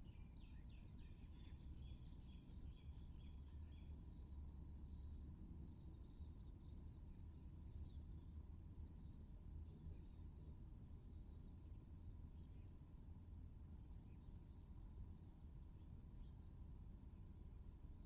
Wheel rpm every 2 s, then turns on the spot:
0, 0, 0, 0, 0, 0, 0, 0, 0.
none